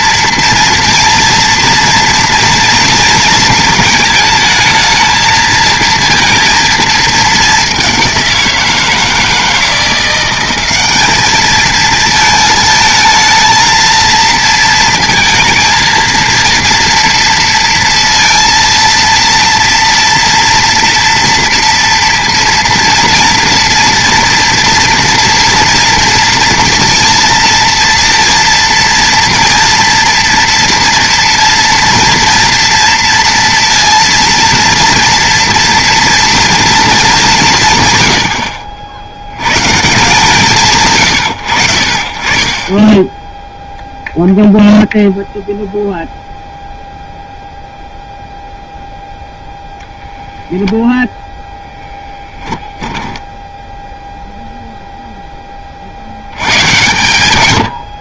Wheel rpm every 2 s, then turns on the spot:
230, 230, 220, 220, 170, 200, 220, 230, 230, 230, 230, 230, 230, 230, 230, 240, 230, 230, 220, 70, 150, 10, 0, 0, 0, 0, 10, 0, 120.
52-54